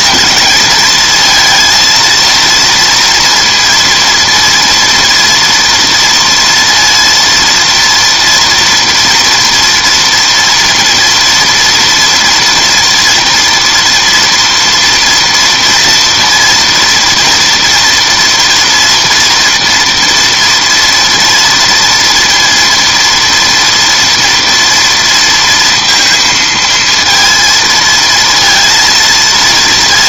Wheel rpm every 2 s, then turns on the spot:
230, 230, 230, 230, 230, 230, 230, 230, 230, 240, 230, 230, 230, 230, 230.
none